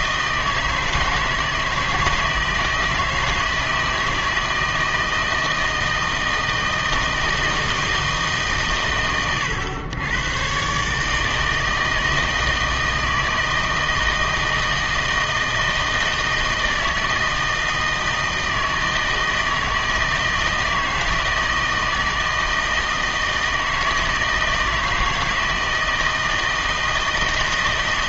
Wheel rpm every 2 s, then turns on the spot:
160, 170, 160, 160, 130, 130, 160, 160, 160, 160, 160, 160, 160, 160.
none